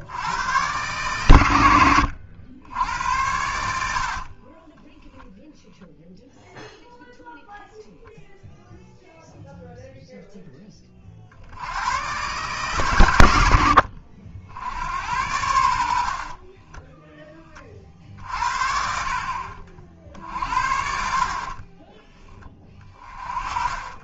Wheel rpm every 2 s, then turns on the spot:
110, 90, 20, 0, 0, 20, 130, 80, 20, 50, 60, 20.
4-6 16-18 22-24